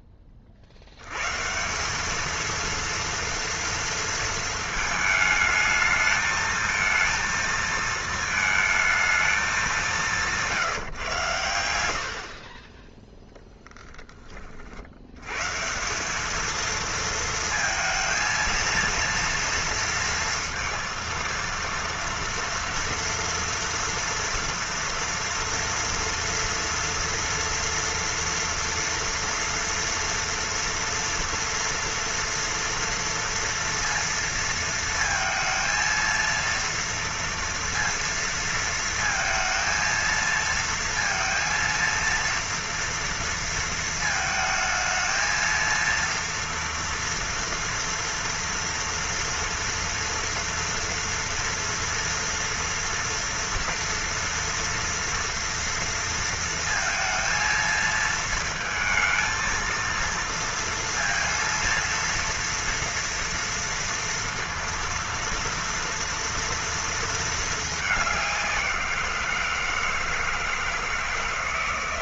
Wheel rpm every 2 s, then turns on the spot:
50, 230, 220, 220, 220, 170, 30, 40, 220, 230, 230, 230, 230, 230, 230, 230, 230, 230, 230, 230, 230, 230, 220, 230, 230, 230, 230, 230, 230, 220, 230, 230, 230, 230, 180, 160.
none